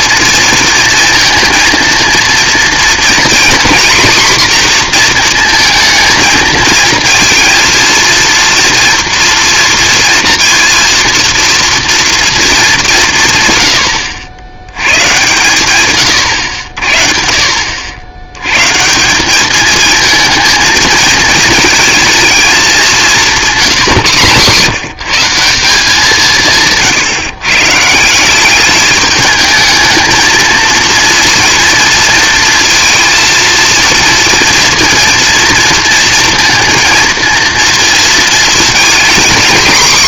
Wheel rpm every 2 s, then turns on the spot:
230, 230, 240, 220, 230, 230, 200, 100, 70, 150, 220, 200, 140, 140, 210, 240, 230, 230, 230, 230.
none